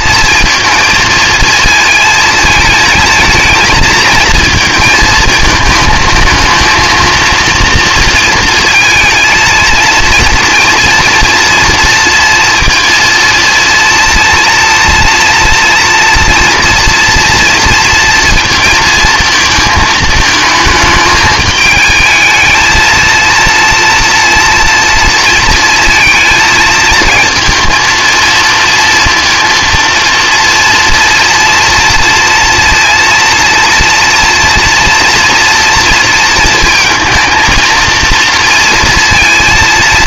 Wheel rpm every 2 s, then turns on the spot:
230, 230, 230, 220, 230, 230, 230, 230, 240, 230, 220, 220, 240, 220, 230, 230, 230, 230, 230, 230.
none